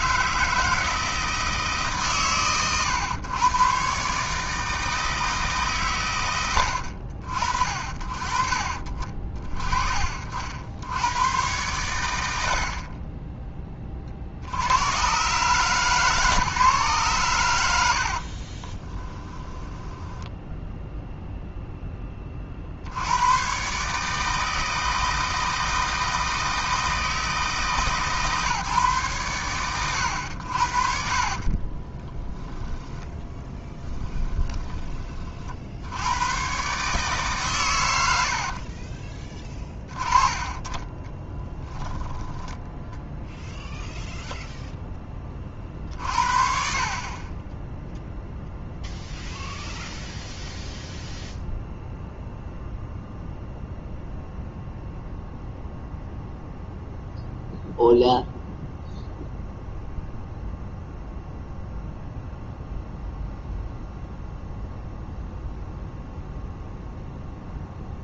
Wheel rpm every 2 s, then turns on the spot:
160, 130, 160, 70, 40, 90, 40, 110, 130, 20, 0, 80, 160, 160, 140, 50, 10, 30, 140, 40, 20, 0, 10, 40, 0, 0, 0, 0, 0, 0, 0, 0, 0, 0.
12-14 18-20 32-34 38-42